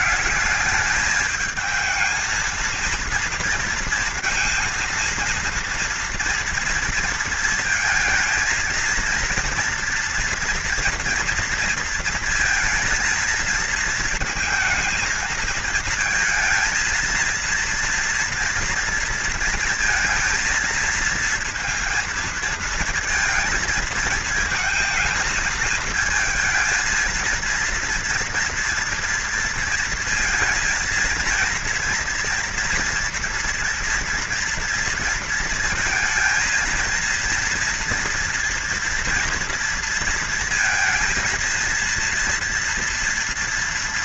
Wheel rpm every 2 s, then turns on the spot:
210, 230, 230, 230, 230, 230, 230, 220, 230, 230, 230, 220, 220, 230, 230, 230, 230, 230, 230, 230, 230, 230.
none